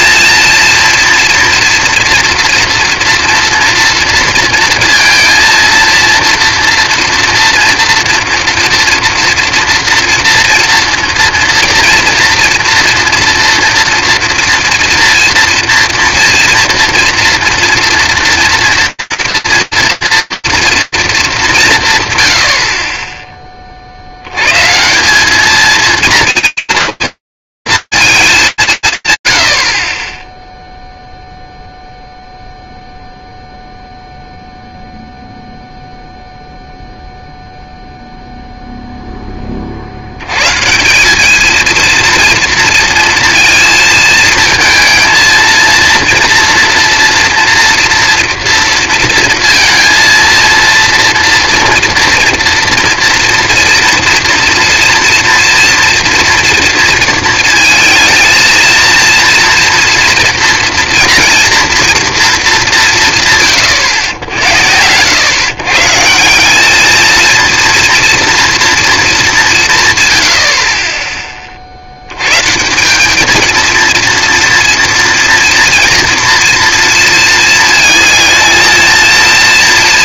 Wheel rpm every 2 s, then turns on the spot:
230, 230, 230, 230, 230, 240, 230, 230, 230, 240, 230, 40, 180, 220, 220, 30, 0, 0, 0, 0, 200, 230, 230, 230, 230, 230, 230, 230, 230, 230, 240, 150, 100, 220, 220, 40, 210, 230, 230, 230.
none